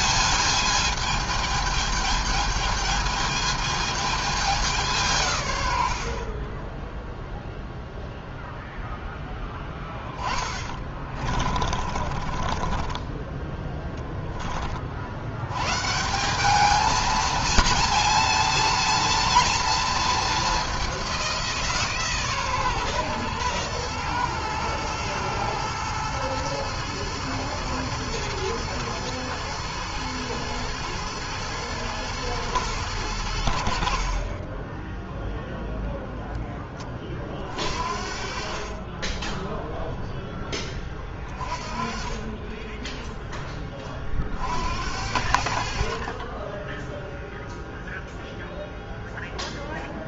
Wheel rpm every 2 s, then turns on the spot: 210, 210, 200, 30, 0, 20, 30, 30, 200, 230, 210, 140, 110, 110, 110, 110, 110, 30, 10, 40, 10, 20, 50, 20, 0.
10-14 42-44